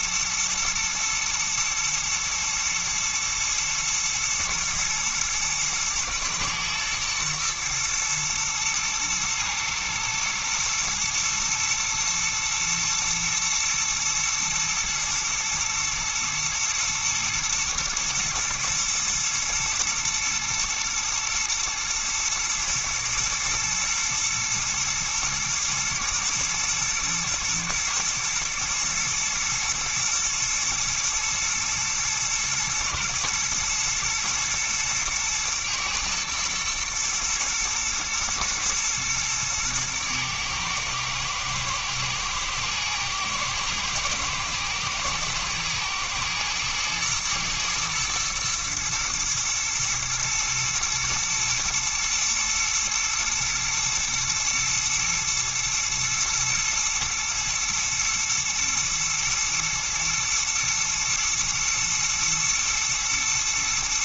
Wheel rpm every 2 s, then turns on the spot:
120, 110, 120, 120, 120, 110, 110, 110, 110, 110, 120, 120, 120, 110, 110, 110, 120, 120, 110, 110, 110, 120, 110, 110, 110, 120, 120, 120, 110, 120, 110, 110.
none